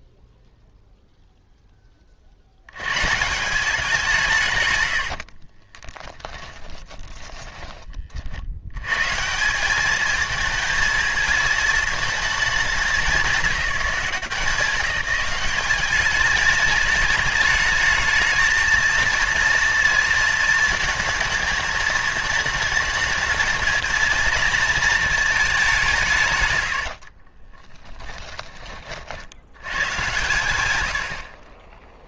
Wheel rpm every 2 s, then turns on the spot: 0, 90, 140, 10, 110, 220, 210, 180, 210, 220, 220, 220, 230, 80, 40, 90.
6-8 26-28